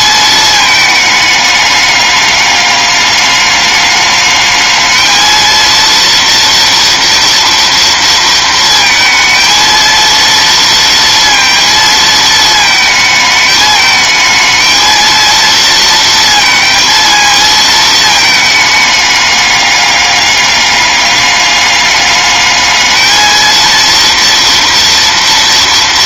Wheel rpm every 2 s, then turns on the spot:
220, 210, 220, 230, 230, 230, 220, 220, 230, 210, 200, 210, 230.
none